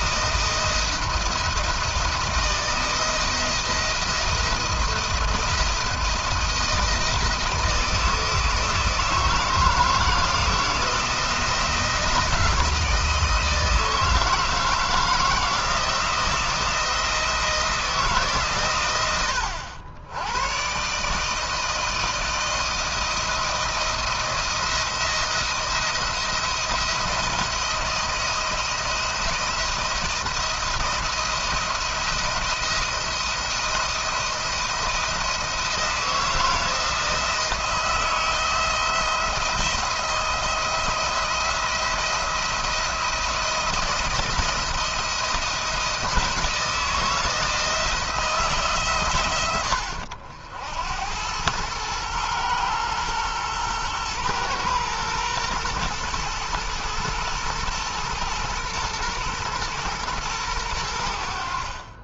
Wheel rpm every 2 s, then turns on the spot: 160, 160, 170, 170, 160, 170, 160, 160, 160, 110, 120, 170, 170, 170, 170, 170, 170, 170, 160, 170, 170, 170, 170, 160, 140, 80, 120, 120, 120, 120, 90.
none